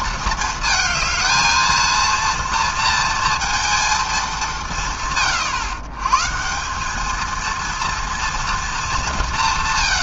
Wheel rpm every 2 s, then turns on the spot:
220, 230, 160, 190, 220.
none